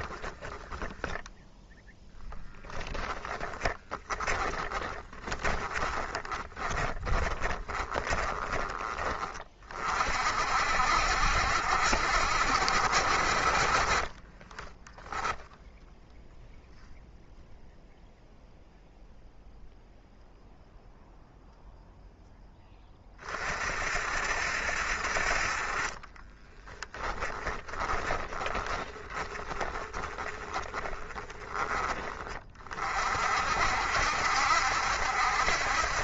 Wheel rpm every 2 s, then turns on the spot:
20, 10, 30, 30, 20, 60, 60, 20, 0, 0, 0, 20, 60, 10, 20, 20, 40, 70.
0-8 26-32